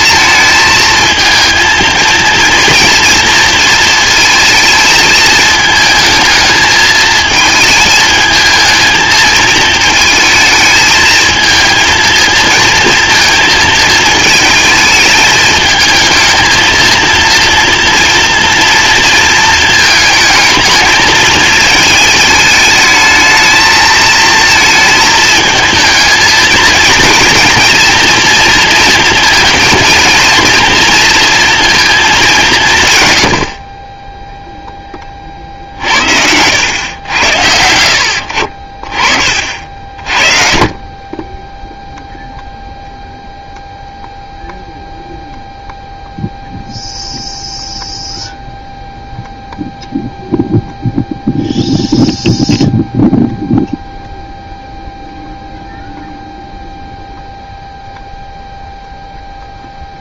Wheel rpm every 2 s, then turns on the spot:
220, 230, 220, 220, 220, 220, 230, 220, 230, 230, 220, 220, 220, 230, 230, 240, 130, 20, 100, 30, 30, 0, 0, 0, 0, 0, 0, 0, 0, 0.
none